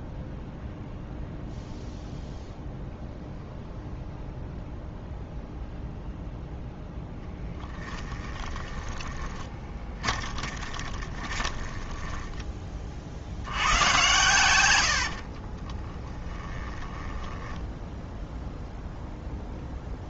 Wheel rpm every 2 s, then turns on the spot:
0, 0, 0, 0, 30, 20, 40, 80, 20, 0.
8-12 14-18